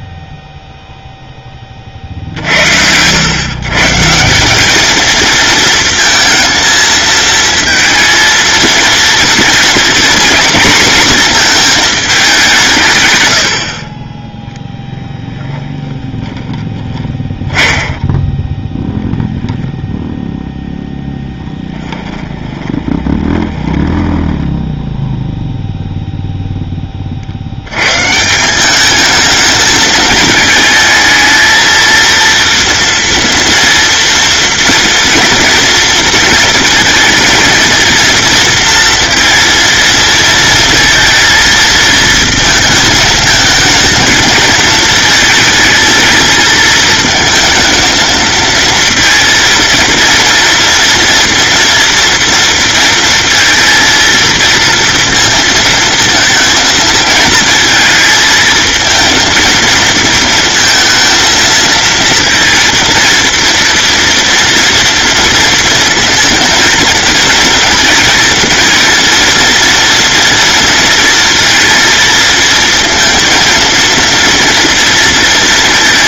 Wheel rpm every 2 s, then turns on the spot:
0, 80, 210, 230, 230, 230, 150, 0, 10, 10, 0, 30, 10, 10, 190, 220, 230, 240, 230, 230, 230, 220, 220, 230, 230, 240, 230, 230, 230, 230, 230, 230, 230, 230, 230, 230, 230, 230.
16-20 22-24